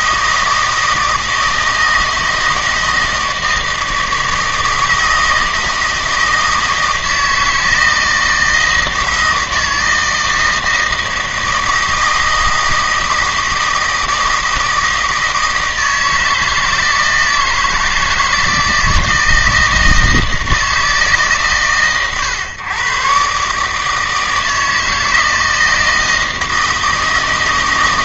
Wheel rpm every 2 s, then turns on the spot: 160, 160, 160, 160, 160, 160, 160, 160, 160, 160, 160, 120, 160, 160.
none